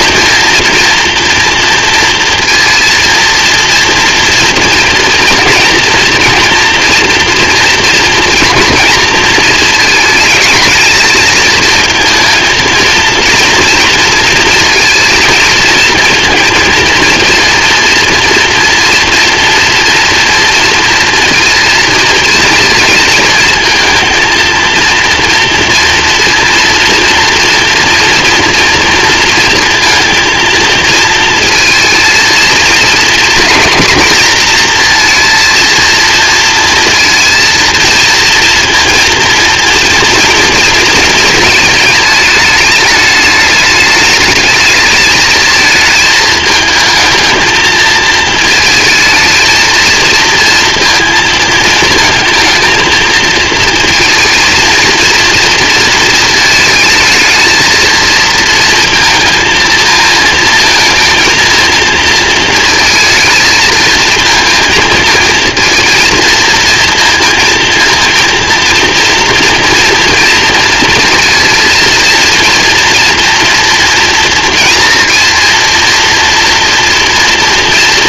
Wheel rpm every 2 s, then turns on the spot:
230, 230, 230, 230, 230, 220, 220, 220, 220, 230, 230, 220, 230, 230, 230, 230, 230, 240, 230, 230, 230, 210, 220, 220, 220, 230, 220, 230, 220, 230, 230, 220, 230, 230, 230, 240, 230, 230, 230.
none